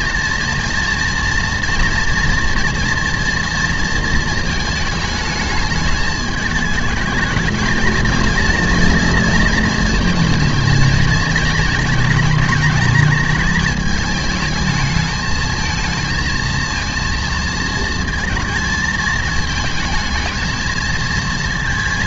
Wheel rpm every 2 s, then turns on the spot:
230, 230, 220, 220, 230, 220, 210, 220, 230, 230, 230.
none